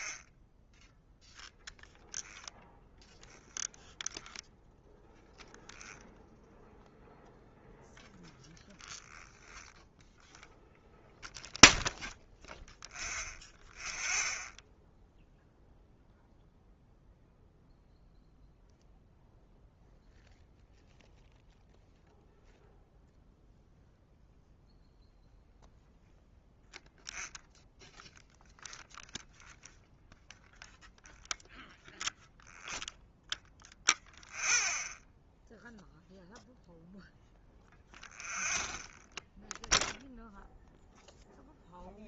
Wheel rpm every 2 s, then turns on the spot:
0, 0, 0, 0, 0, 0, 0, 0, 0, 0, 0, 0, 0, 0, 0, 0, 0, 0, 0, 0, 0.
none